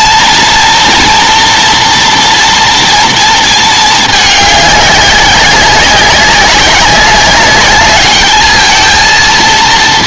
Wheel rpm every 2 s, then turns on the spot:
230, 230, 200, 190, 220.
none